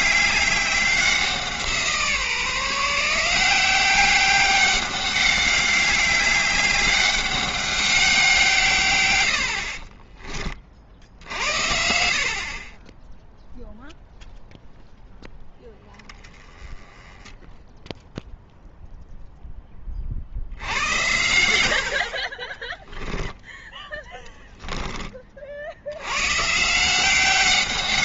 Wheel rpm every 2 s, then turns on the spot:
190, 160, 190, 200, 150, 50, 30, 0, 10, 0, 80, 20, 20, 160.
22-26